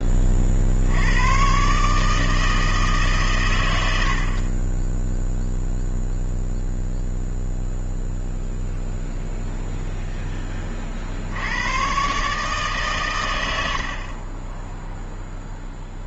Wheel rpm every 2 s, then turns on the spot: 80, 150, 10, 0, 0, 50, 130, 0.
none